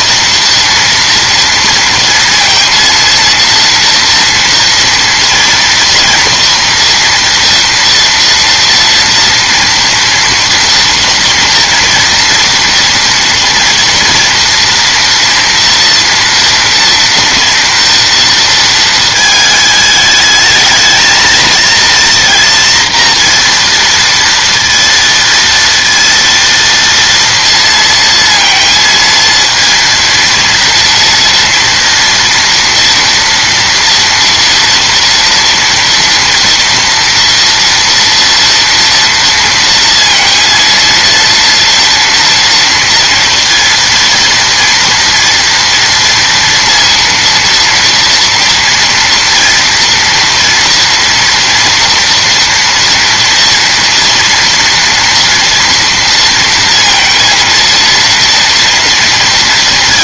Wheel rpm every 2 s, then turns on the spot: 230, 230, 240, 230, 230, 230, 230, 230, 230, 220, 220, 230, 230, 230, 230, 230, 240, 230, 240, 230, 230, 230, 230, 230, 230, 240, 240, 230, 230, 230.
none